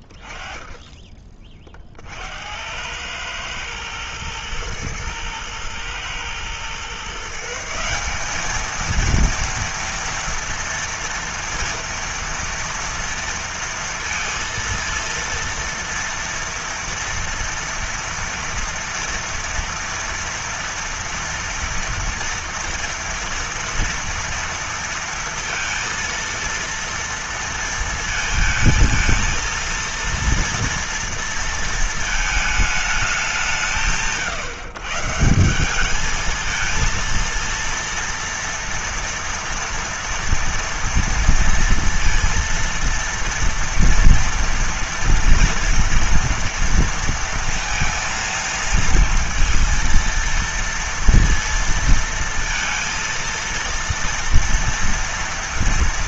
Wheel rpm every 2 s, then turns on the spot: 50, 50, 110, 110, 180, 230, 230, 230, 230, 230, 230, 230, 230, 230, 220, 230, 220, 130, 220, 240, 230, 230, 230, 230, 230, 230, 230, 230.
none